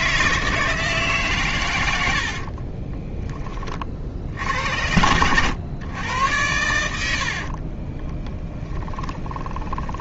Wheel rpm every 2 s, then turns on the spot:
160, 20, 90, 80, 10.
2-4 8-10